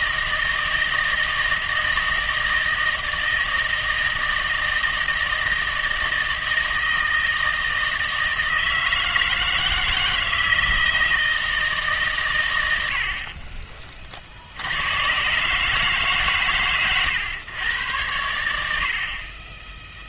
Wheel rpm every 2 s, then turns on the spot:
160, 160, 160, 160, 160, 160, 90, 90, 120, 70.
none